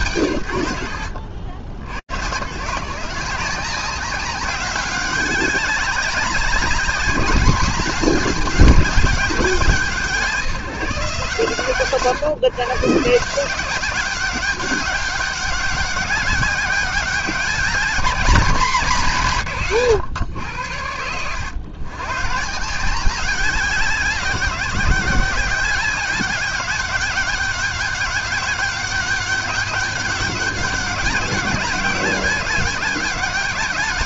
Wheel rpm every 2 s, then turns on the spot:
70, 190, 200, 210, 170, 110, 190, 200, 210, 140, 130, 190, 190, 200, 200, 200, 190.
none